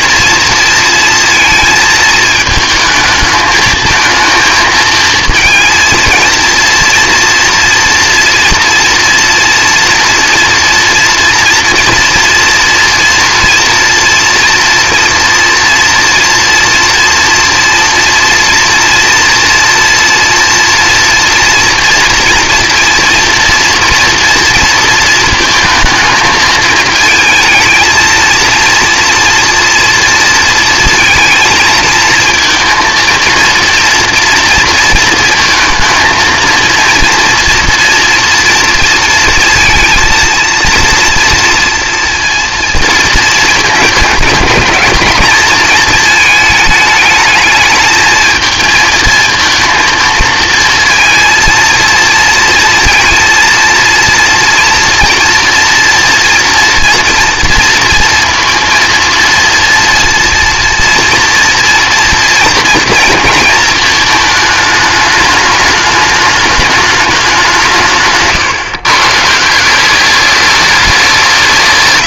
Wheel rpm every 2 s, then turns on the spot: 230, 220, 230, 230, 230, 230, 240, 230, 230, 230, 230, 230, 230, 220, 230, 230, 230, 230, 230, 230, 230, 230, 210, 220, 220, 230, 230, 230, 230, 230, 230, 230, 210, 210, 130, 210.
none